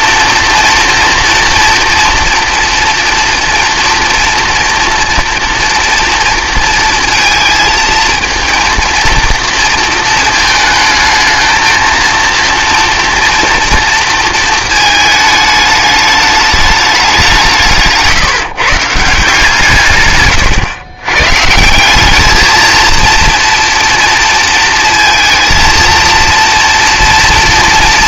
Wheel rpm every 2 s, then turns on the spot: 240, 230, 230, 230, 230, 220, 230, 220, 210, 160, 120, 220, 230, 230.
none